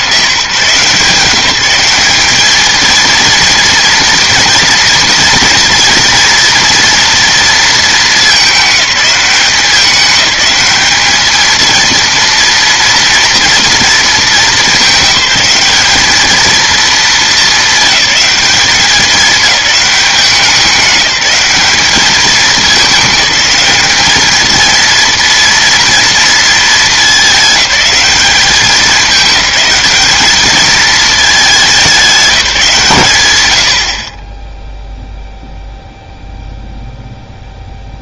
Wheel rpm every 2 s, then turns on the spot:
170, 220, 230, 230, 210, 210, 230, 200, 220, 210, 190, 210, 220, 220, 200, 210, 170, 10, 0.
none